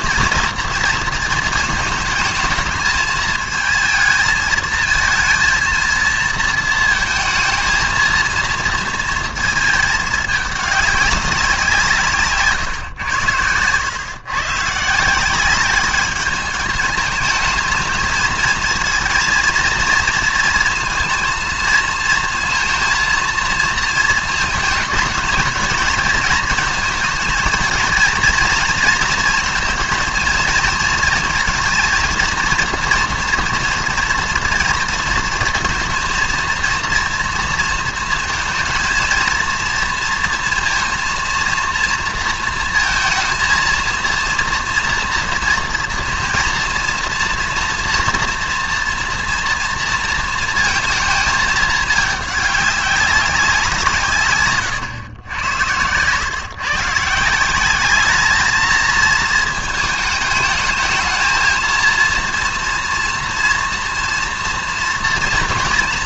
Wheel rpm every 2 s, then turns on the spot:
230, 210, 220, 230, 230, 210, 140, 130, 210, 220, 230, 230, 220, 230, 230, 230, 230, 230, 230, 220, 230, 230, 230, 230, 230, 230, 210, 120, 140, 220, 220, 230, 240.
none